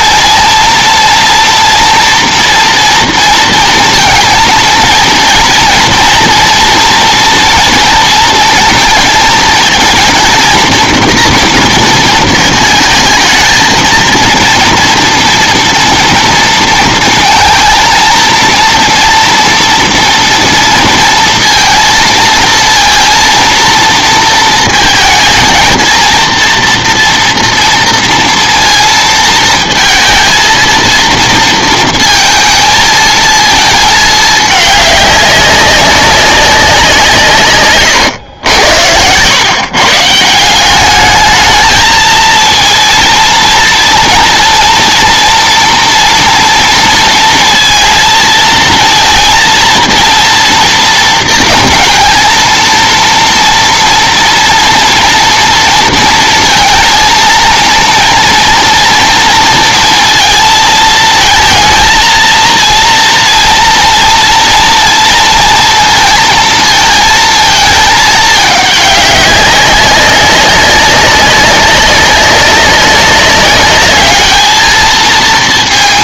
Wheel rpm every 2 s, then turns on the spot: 230, 230, 230, 230, 230, 230, 220, 230, 230, 230, 230, 230, 220, 230, 230, 230, 220, 210, 190, 90, 190, 230, 230, 230, 230, 230, 230, 240, 230, 230, 220, 230, 230, 230, 210, 200, 200, 210.
none